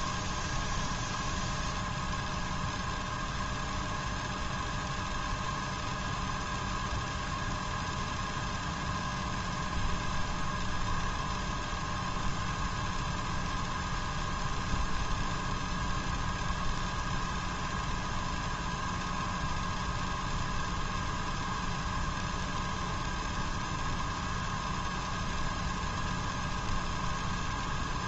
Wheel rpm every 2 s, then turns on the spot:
0, 0, 0, 0, 0, 0, 0, 0, 0, 0, 0, 0, 0, 0.
none